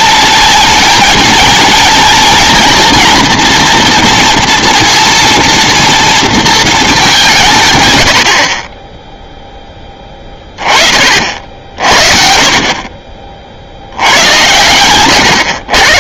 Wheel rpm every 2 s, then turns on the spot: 230, 230, 230, 230, 50, 30, 50, 110.
14-16